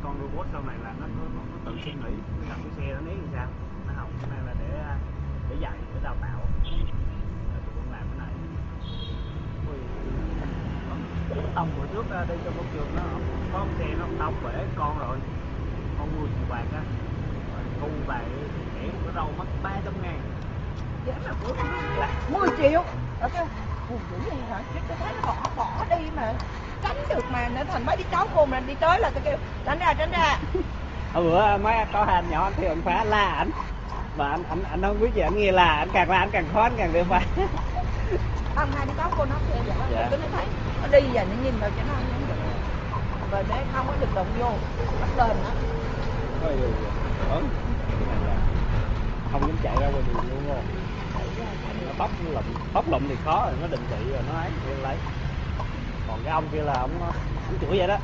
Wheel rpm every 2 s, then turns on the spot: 0, 0, 0, 0, 0, 0, 0, 0, 0, 0, 0, 0, 0, 0, 0, 0, 0, 0, 0, 0, 0, 0, 0, 0, 0, 0, 0, 0, 0.
none